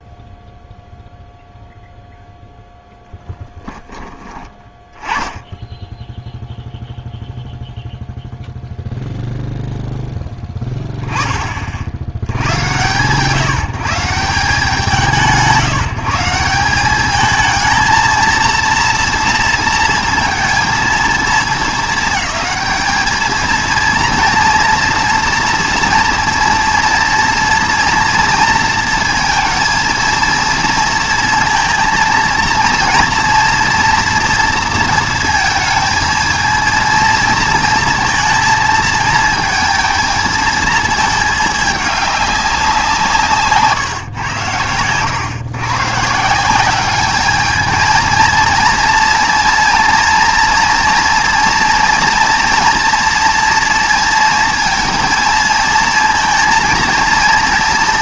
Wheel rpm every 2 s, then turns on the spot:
0, 0, 20, 0, 0, 10, 120, 180, 190, 230, 230, 220, 230, 240, 230, 230, 230, 230, 230, 220, 220, 180, 100, 200, 230, 230, 230, 230, 230.
none